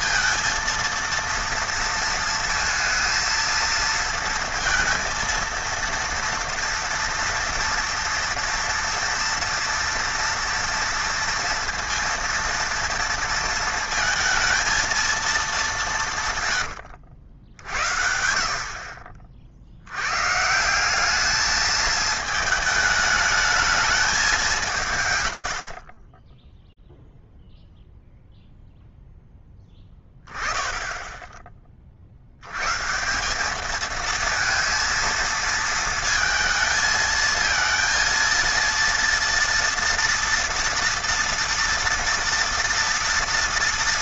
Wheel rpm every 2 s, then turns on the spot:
230, 230, 230, 230, 230, 230, 230, 220, 130, 50, 150, 220, 190, 20, 0, 10, 100, 220, 220, 230, 230, 230.
26-28